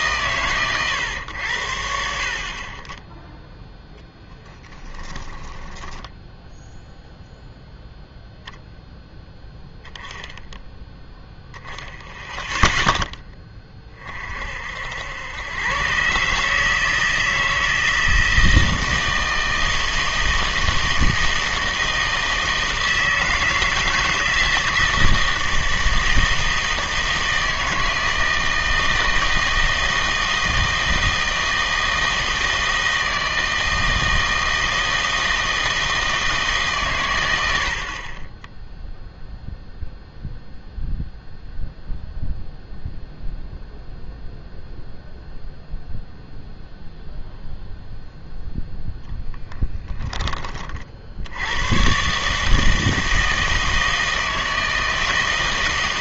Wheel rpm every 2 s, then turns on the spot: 130, 40, 10, 0, 0, 0, 0, 60, 150, 160, 160, 160, 160, 160, 160, 160, 160, 160, 140, 10, 0, 0, 0, 0, 0, 30, 160, 160.
4-6